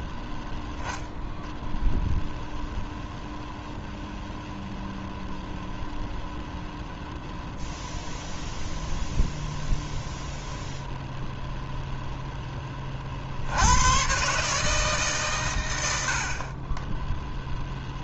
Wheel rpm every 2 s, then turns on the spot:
0, 0, 0, 0, 0, 0, 20, 150, 20.
none